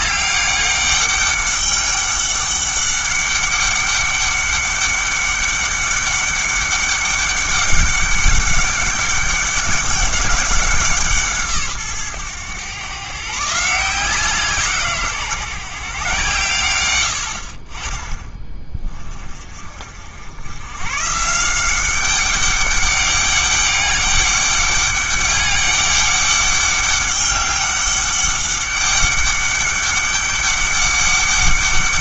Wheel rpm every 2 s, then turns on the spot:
200, 200, 200, 200, 200, 180, 120, 160, 110, 20, 130, 200, 200, 200, 200, 200.
none